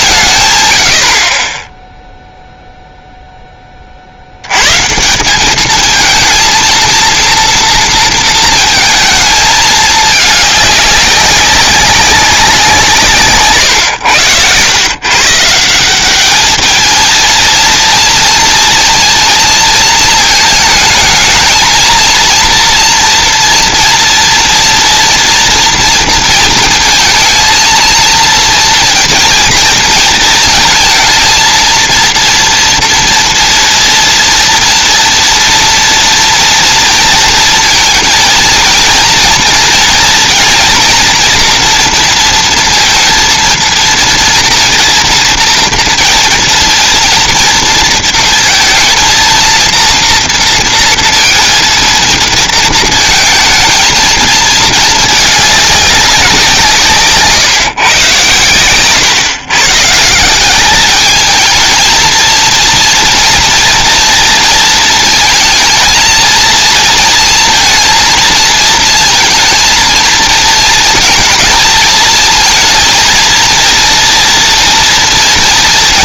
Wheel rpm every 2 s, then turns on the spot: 100, 0, 130, 230, 220, 200, 170, 120, 220, 230, 220, 230, 230, 220, 230, 230, 230, 230, 230, 230, 230, 230, 230, 230, 230, 230, 220, 220, 160, 110, 200, 230, 230, 230, 220, 230, 230, 230.
none